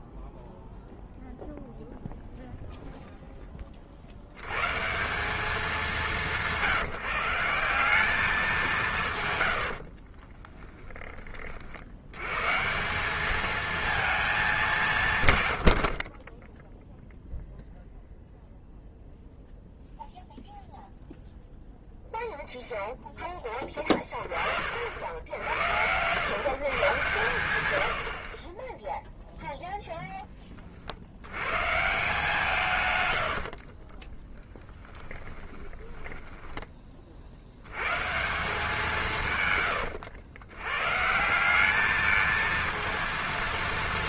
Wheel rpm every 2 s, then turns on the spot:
0, 0, 170, 160, 150, 40, 180, 170, 0, 0, 0, 0, 40, 140, 10, 40, 150, 10, 20, 170, 110, 230.
10-12 34-36